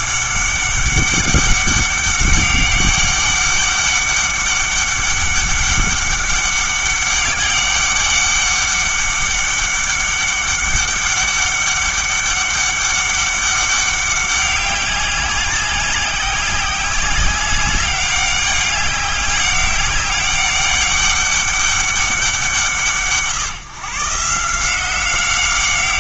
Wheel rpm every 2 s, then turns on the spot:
200, 200, 200, 200, 200, 200, 200, 200, 190, 190, 200, 170, 170.
none